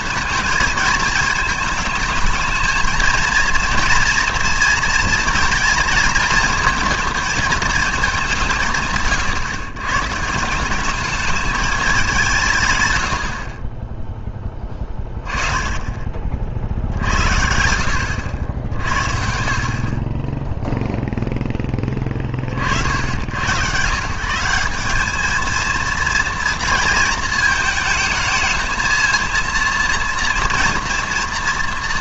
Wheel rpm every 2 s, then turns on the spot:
230, 220, 230, 230, 160, 180, 130, 20, 60, 60, 0, 60, 190, 230, 220, 230.
none